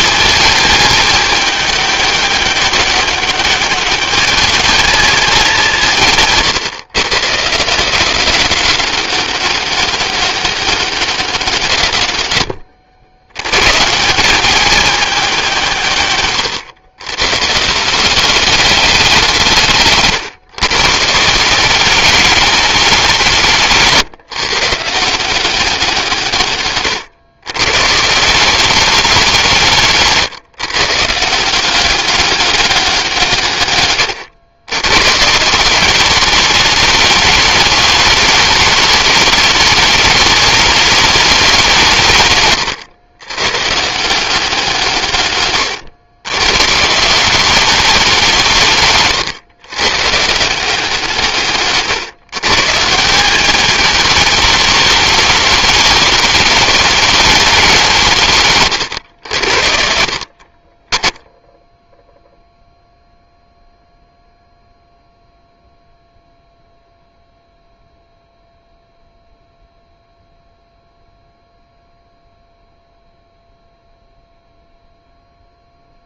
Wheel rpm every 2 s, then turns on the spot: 210, 200, 180, 150, 190, 170, 130, 170, 150, 160, 190, 160, 180, 130, 170, 180, 140, 180, 210, 210, 180, 140, 110, 200, 120, 140, 210, 210, 200, 70, 10, 0, 0, 0, 0, 0, 0, 0.
none